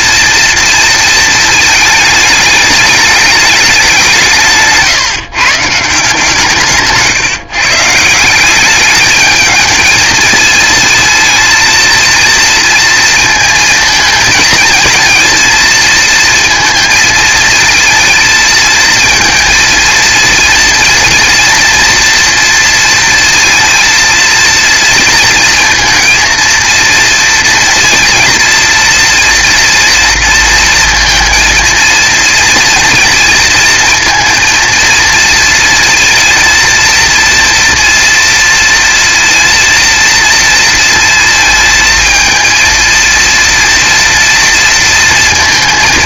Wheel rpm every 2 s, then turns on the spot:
230, 210, 150, 150, 210, 220, 230, 230, 220, 220, 230, 230, 230, 230, 230, 230, 230, 230, 230, 230, 230, 230, 230.
none